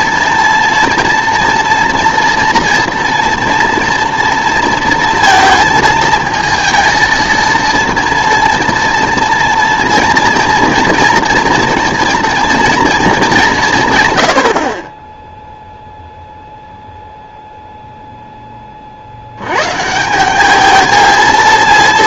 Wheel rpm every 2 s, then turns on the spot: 230, 230, 230, 220, 230, 230, 230, 40, 0, 20, 210.
none